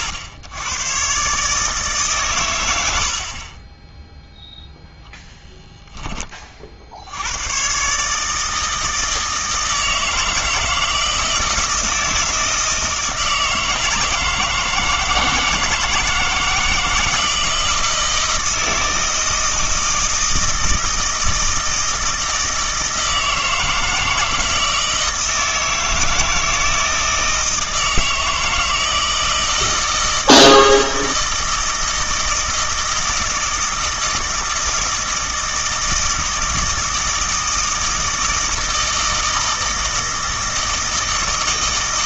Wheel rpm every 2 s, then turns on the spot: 110, 100, 0, 50, 160, 160, 160, 160, 160, 160, 160, 160, 160, 160, 160, 160, 160, 160, 160, 160, 160.
none